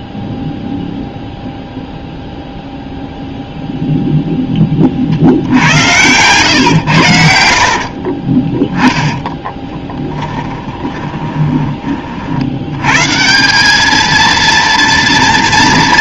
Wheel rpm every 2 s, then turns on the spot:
0, 0, 20, 100, 10, 20, 110, 230.
6-8 10-12